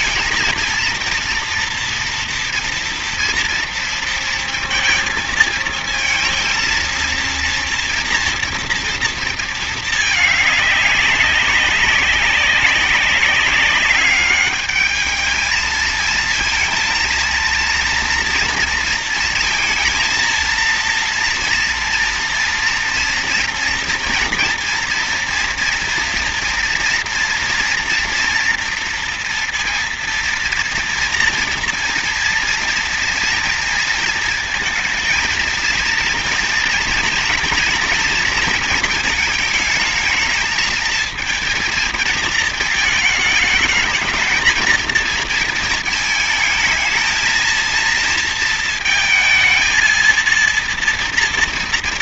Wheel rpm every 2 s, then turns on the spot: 230, 230, 230, 230, 230, 200, 190, 210, 230, 230, 230, 230, 230, 240, 240, 230, 240, 230, 230, 230, 220, 220, 230, 220, 230, 230.
none